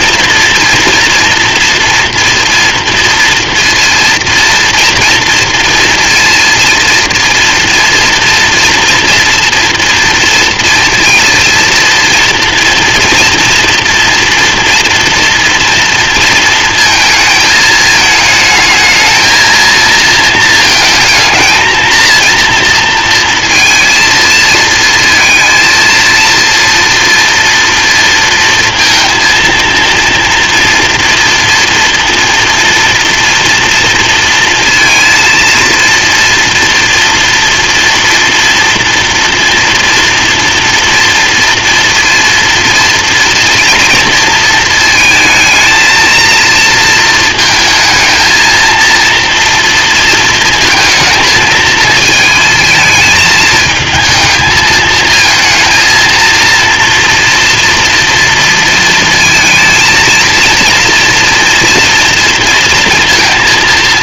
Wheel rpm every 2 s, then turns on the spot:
230, 230, 230, 230, 230, 230, 230, 230, 230, 220, 220, 240, 230, 230, 230, 230, 230, 230, 230, 230, 230, 230, 220, 230, 230, 220, 220, 220, 230, 230, 230, 230.
none